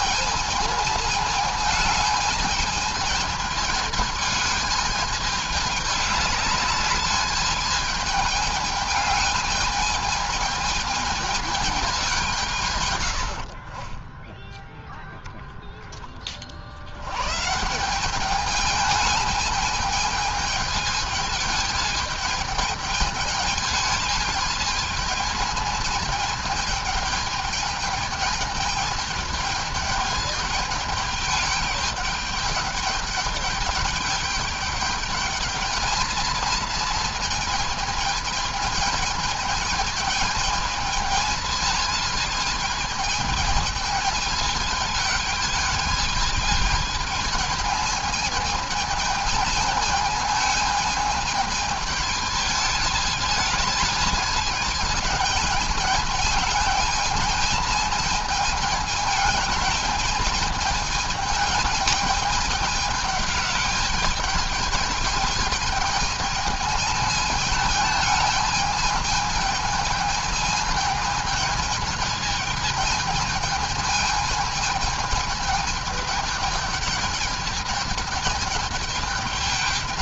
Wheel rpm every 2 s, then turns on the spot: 220, 220, 210, 210, 210, 220, 120, 0, 90, 210, 210, 210, 220, 210, 220, 210, 210, 210, 230, 220, 210, 210, 210, 220, 220, 220, 220, 210, 210, 220, 220, 210, 220, 220, 220, 220, 210, 220, 210, 220.
none